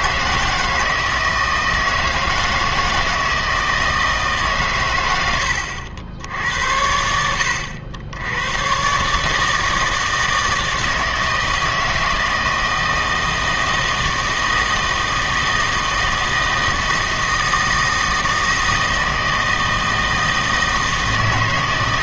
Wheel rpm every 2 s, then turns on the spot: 160, 160, 130, 70, 120, 160, 160, 160, 160, 160, 160.
none